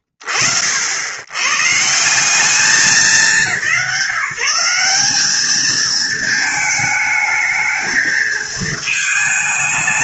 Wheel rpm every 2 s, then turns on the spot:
70, 190, 210, 220, 220.
none